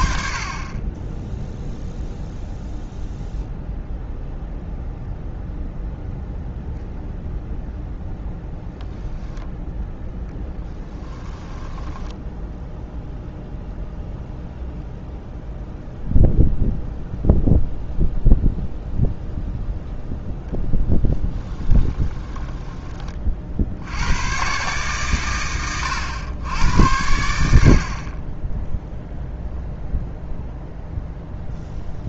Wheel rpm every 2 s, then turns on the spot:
30, 0, 0, 0, 0, 10, 0, 0, 0, 0, 10, 20, 130, 90, 0, 0.
10-12